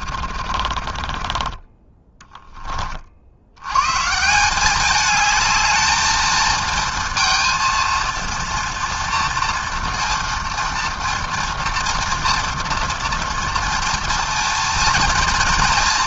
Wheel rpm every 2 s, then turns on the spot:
40, 70, 210, 230, 230, 240, 230, 230.
0-2